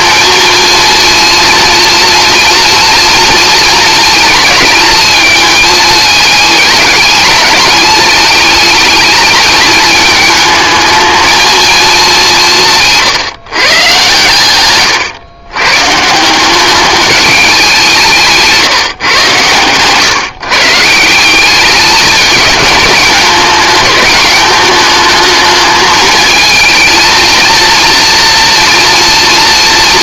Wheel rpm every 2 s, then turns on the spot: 230, 230, 220, 220, 220, 210, 170, 120, 200, 150, 150, 210, 210, 220, 230.
18-20